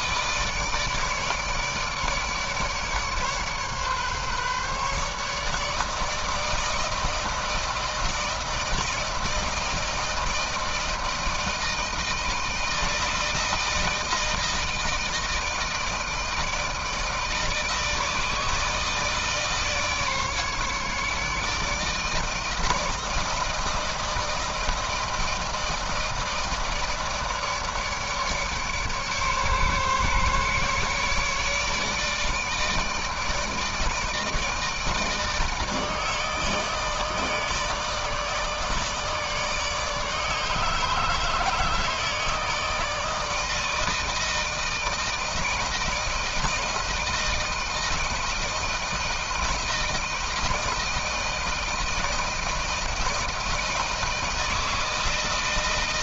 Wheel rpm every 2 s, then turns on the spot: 150, 140, 150, 160, 160, 160, 160, 160, 160, 160, 150, 160, 160, 160, 140, 150, 160, 160, 160, 150, 150, 160, 160, 160, 160, 160, 160, 160.
none